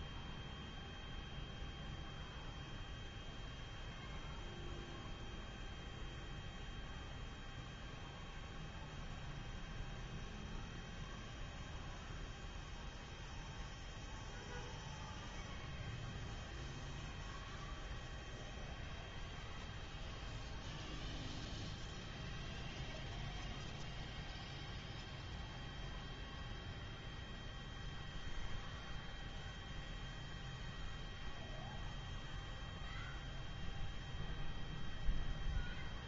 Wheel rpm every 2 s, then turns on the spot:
0, 0, 0, 0, 0, 0, 0, 0, 0, 0, 0, 0, 0, 0, 0, 0, 0, 0.
none